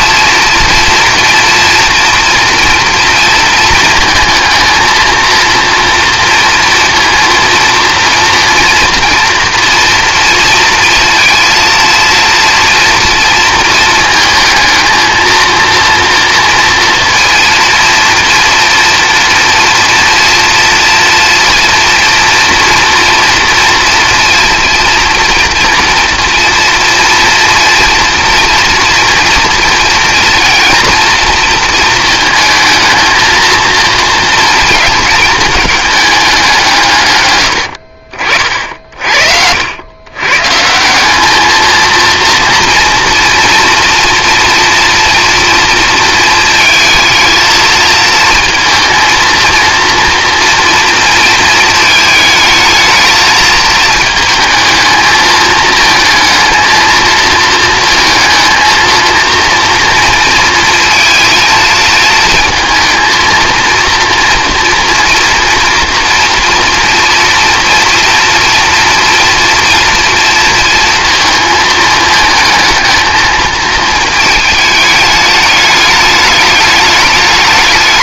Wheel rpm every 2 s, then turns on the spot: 230, 230, 220, 230, 230, 230, 230, 220, 230, 230, 230, 230, 230, 240, 240, 240, 220, 220, 160, 50, 170, 230, 230, 230, 230, 230, 220, 220, 230, 230, 230, 230, 230, 230, 230, 230, 220, 210, 210.
38-40